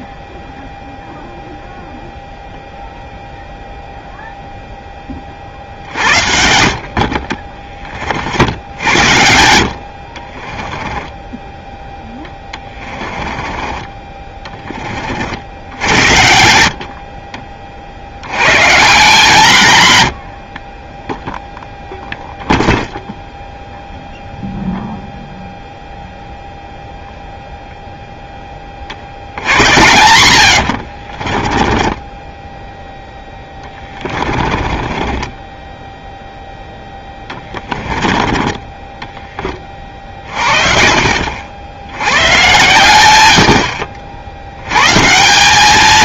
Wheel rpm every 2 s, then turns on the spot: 0, 0, 0, 50, 70, 20, 20, 30, 70, 130, 30, 0, 0, 0, 30, 60, 10, 20, 0, 20, 40, 120, 110.
10-14 30-32 34-36 38-40